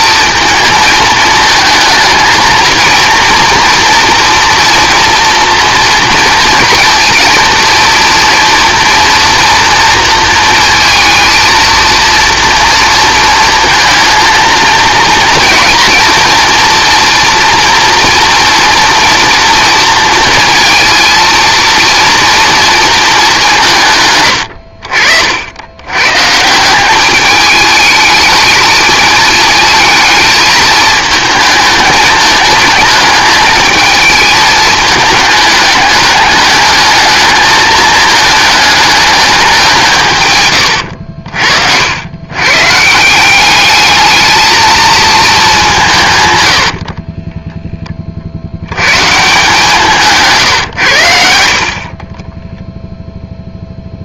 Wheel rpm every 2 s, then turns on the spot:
220, 220, 240, 230, 230, 230, 230, 230, 230, 230, 230, 230, 100, 160, 220, 220, 220, 220, 210, 220, 120, 130, 220, 80, 120, 110, 0.
24-26 46-48